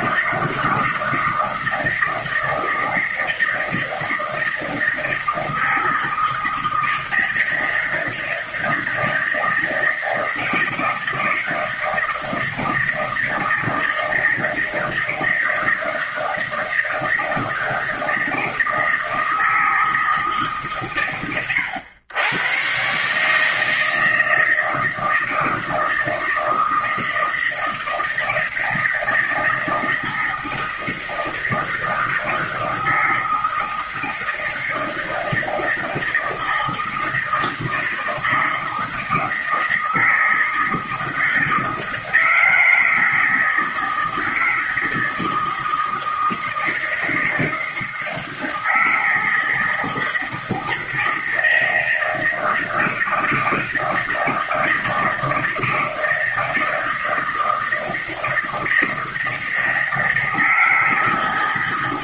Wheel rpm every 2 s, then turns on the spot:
160, 160, 160, 160, 160, 160, 160, 160, 160, 160, 110, 140, 160, 160, 160, 160, 160, 160, 160, 160, 160, 160, 160, 160, 160, 160, 160, 160, 160, 160, 160.
none